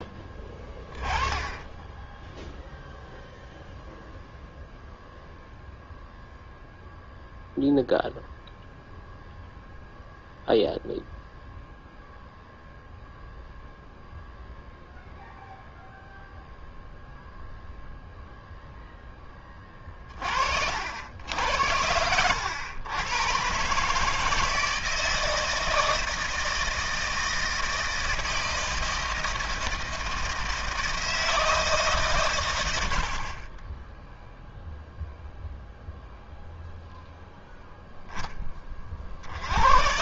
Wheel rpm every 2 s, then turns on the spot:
10, 0, 0, 0, 0, 0, 0, 0, 0, 0, 60, 100, 160, 160, 160, 160, 110, 0, 0, 30.
none